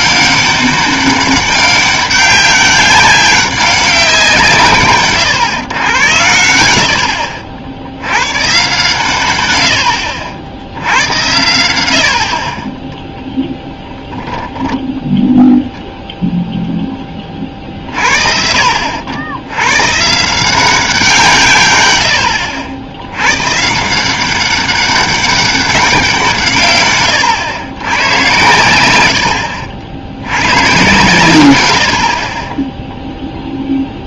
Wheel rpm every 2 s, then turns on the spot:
200, 190, 140, 70, 130, 80, 20, 10, 10, 70, 180, 90, 200, 130, 100, 120, 10.
12-14